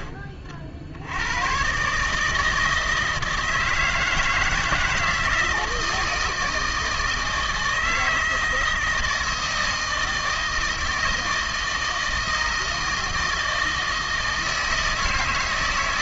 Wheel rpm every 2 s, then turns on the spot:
40, 160, 160, 160, 160, 160, 160, 160.
none